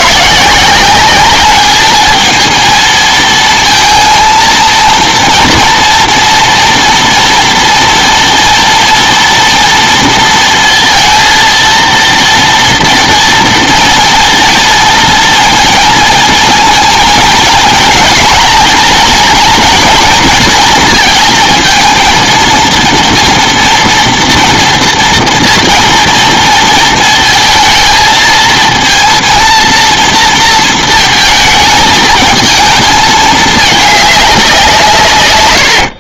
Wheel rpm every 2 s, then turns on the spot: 170, 220, 230, 230, 230, 230, 230, 230, 230, 230, 230, 230, 230, 230, 230, 230, 220, 180.
none